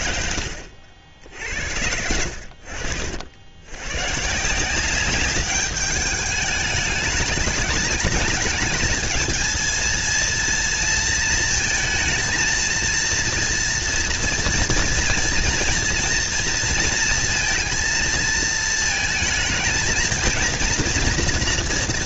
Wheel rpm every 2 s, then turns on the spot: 90, 50, 180, 210, 220, 230, 230, 230, 230, 220, 230.
0-2